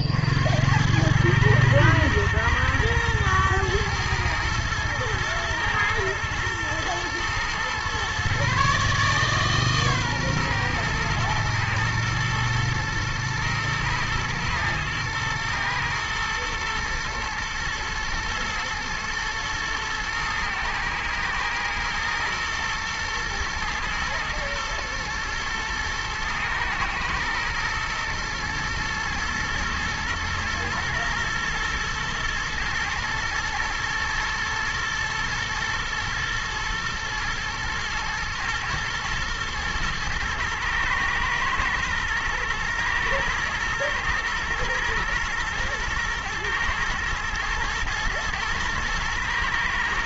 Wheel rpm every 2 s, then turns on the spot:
80, 110, 110, 110, 140, 120, 110, 110, 110, 120, 110, 120, 110, 110, 120, 120, 120, 110, 120, 120, 110, 110, 120, 110, 110.
none